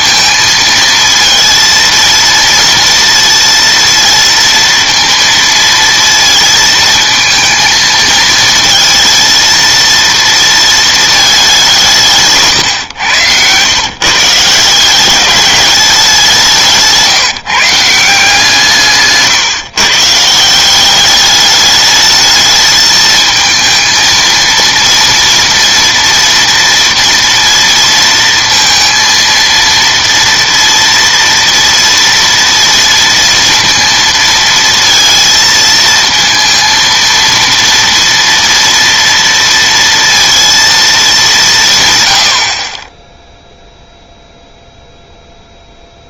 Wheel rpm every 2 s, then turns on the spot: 230, 230, 230, 230, 230, 220, 130, 170, 170, 160, 180, 220, 230, 240, 230, 230, 230, 230, 230, 230, 230, 50, 0.
12-14